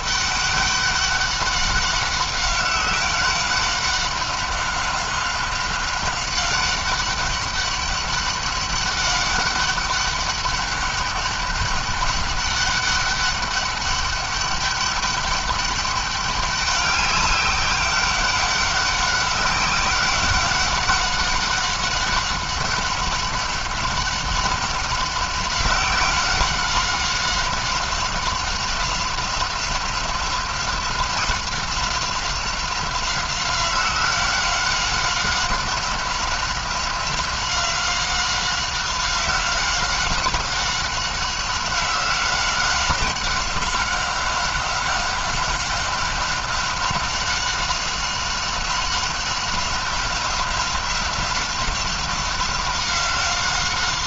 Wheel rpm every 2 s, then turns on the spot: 200, 190, 190, 190, 190, 200, 200, 200, 200, 190, 190, 190, 190, 190, 190, 180, 190, 190, 190, 190, 190, 190, 190, 190, 190, 190, 190.
none